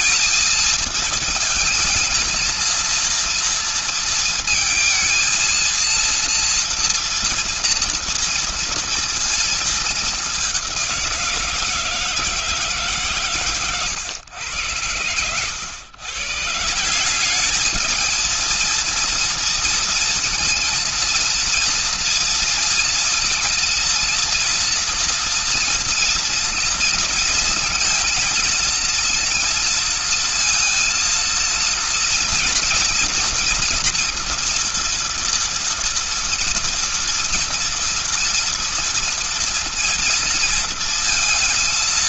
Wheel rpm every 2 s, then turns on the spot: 220, 230, 230, 230, 230, 210, 160, 100, 120, 230, 230, 230, 230, 230, 230, 230, 230, 230, 230, 230, 230.
none